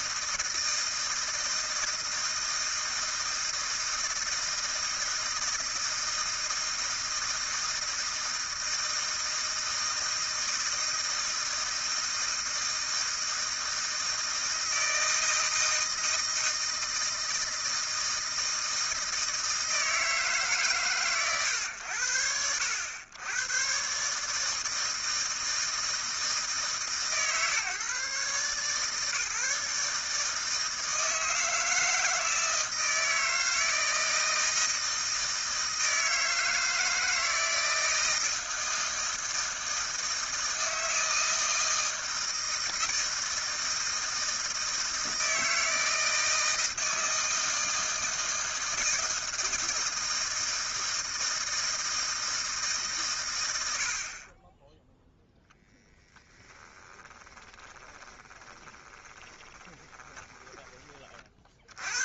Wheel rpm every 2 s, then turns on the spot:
160, 160, 160, 160, 160, 160, 160, 160, 160, 160, 160, 80, 150, 160, 130, 150, 160, 160, 160, 160, 160, 160, 160, 160, 160, 160, 160, 40, 20, 20, 10.
56-62